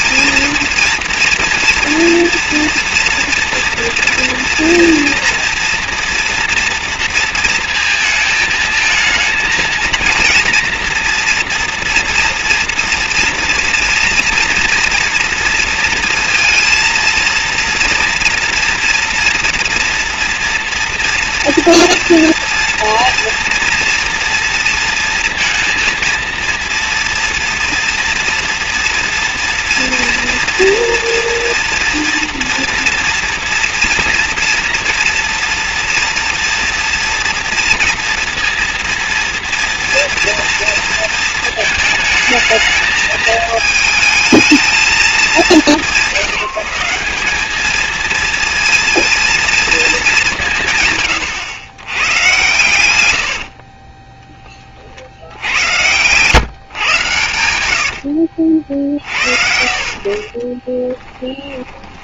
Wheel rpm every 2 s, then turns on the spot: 230, 230, 230, 230, 220, 230, 230, 230, 230, 230, 230, 230, 230, 230, 230, 230, 240, 230, 230, 230, 230, 220, 220, 170, 230, 150, 110, 30, 140, 60, 20.
60-62